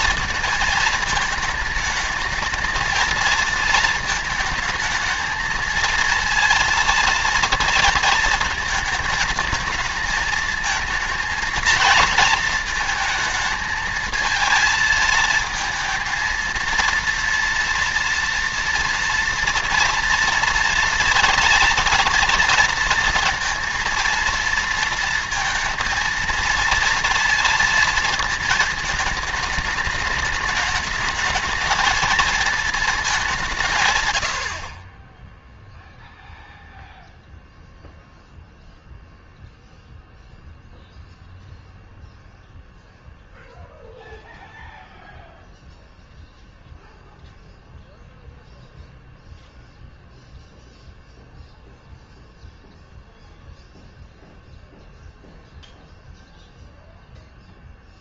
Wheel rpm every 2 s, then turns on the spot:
220, 220, 220, 230, 230, 220, 220, 220, 230, 230, 230, 230, 230, 230, 220, 220, 220, 50, 0, 0, 0, 0, 0, 0, 0, 0, 0, 0, 0.
none